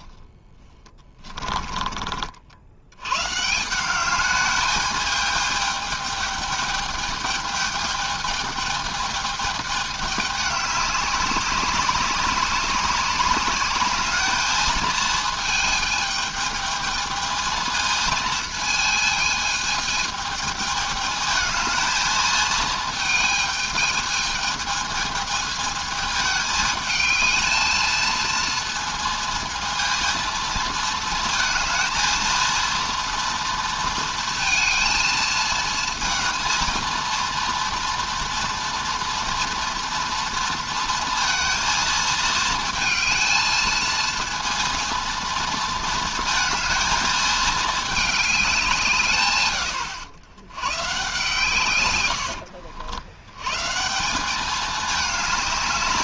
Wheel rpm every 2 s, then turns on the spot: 10, 80, 210, 210, 210, 200, 200, 220, 220, 220, 220, 220, 220, 220, 230, 230, 230, 220, 230, 230, 230, 220, 230, 230, 180, 120, 80, 210.
0-2